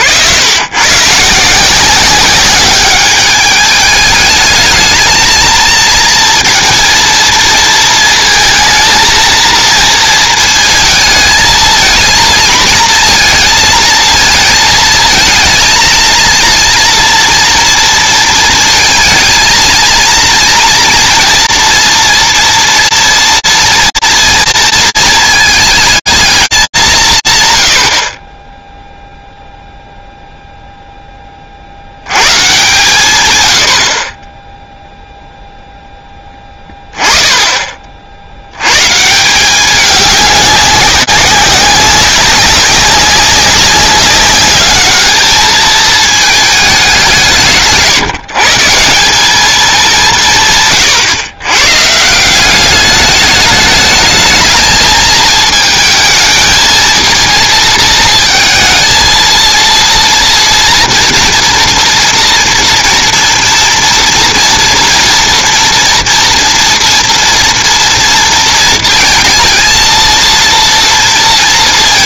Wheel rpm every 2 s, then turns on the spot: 80, 200, 220, 240, 230, 230, 220, 220, 230, 230, 230, 230, 230, 180, 0, 0, 140, 0, 20, 100, 200, 190, 200, 200, 160, 140, 190, 220, 230, 220, 230, 230, 230, 230, 230, 230.
none